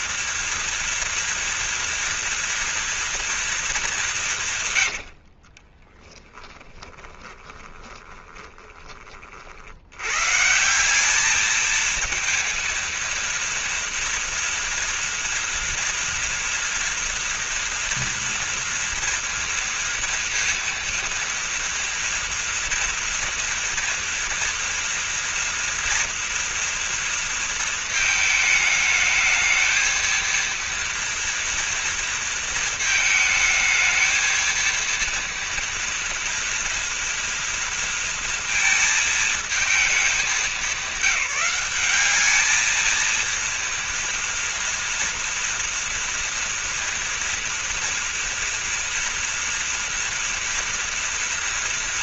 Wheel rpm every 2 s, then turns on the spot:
240, 240, 170, 10, 20, 130, 230, 230, 230, 230, 230, 230, 230, 230, 220, 230, 230, 220, 230, 230, 200, 210, 230, 230, 230, 230.
6-10